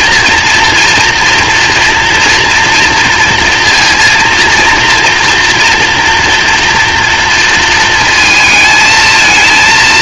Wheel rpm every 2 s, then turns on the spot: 240, 240, 230, 230, 220.
none